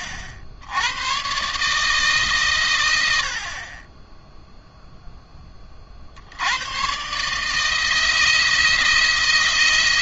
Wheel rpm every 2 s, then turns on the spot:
100, 110, 0, 100, 160.
none